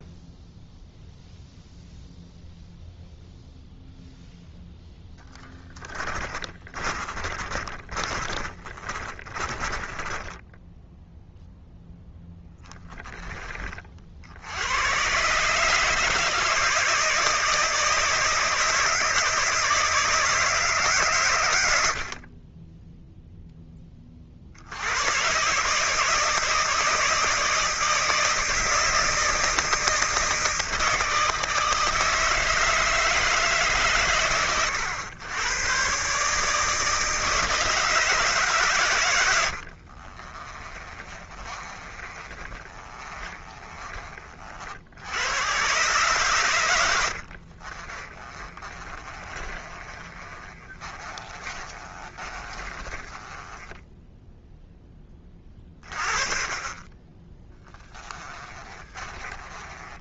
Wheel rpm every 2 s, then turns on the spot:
0, 0, 0, 30, 30, 0, 20, 120, 160, 160, 130, 0, 100, 160, 160, 160, 160, 100, 160, 110, 30, 30, 90, 70, 30, 30, 20, 20, 20, 20.
6-10 38-44 46-54 58-60